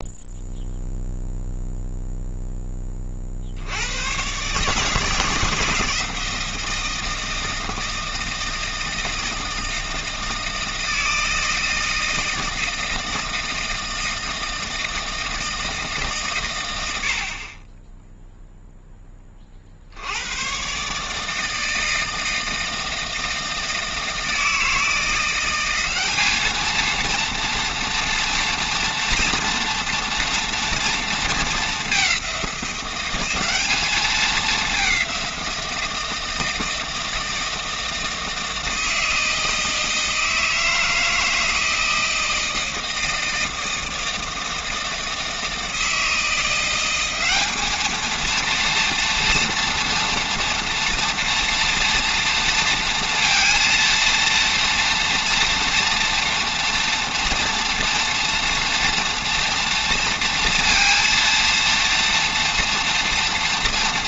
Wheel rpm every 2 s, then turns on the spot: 0, 20, 150, 160, 160, 160, 160, 160, 100, 0, 130, 160, 160, 220, 230, 230, 180, 190, 160, 160, 160, 160, 160, 180, 240, 240, 230, 240, 230, 230, 230, 240.
none